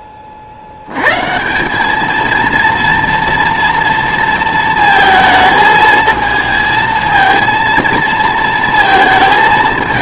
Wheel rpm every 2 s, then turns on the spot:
80, 230, 230, 220, 230.
none